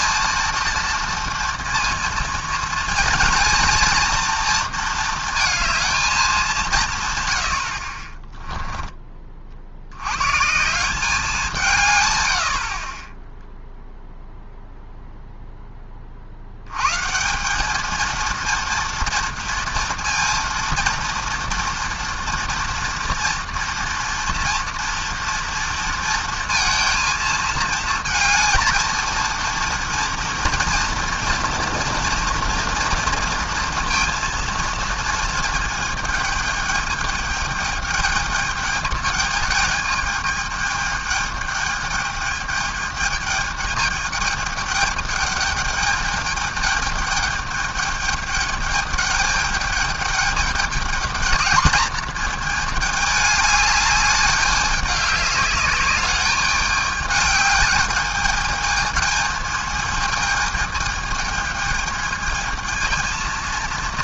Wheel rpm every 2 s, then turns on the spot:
230, 230, 230, 160, 10, 180, 40, 0, 110, 230, 240, 230, 230, 230, 230, 230, 230, 230, 210, 210, 210, 210, 210, 210, 210, 210, 220, 200, 210, 220, 220, 220.
none